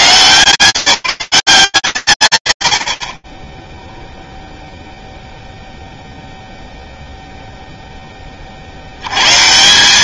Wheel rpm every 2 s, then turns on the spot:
150, 120, 0, 0, 60.
none